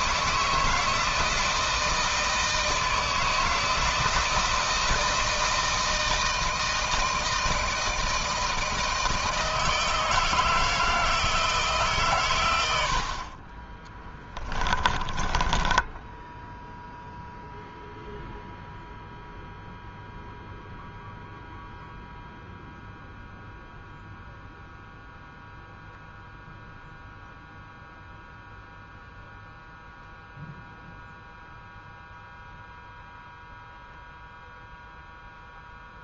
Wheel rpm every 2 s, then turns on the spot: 170, 160, 160, 160, 160, 160, 70, 20, 0, 0, 0, 0, 0, 0, 0, 0, 0, 0.
14-16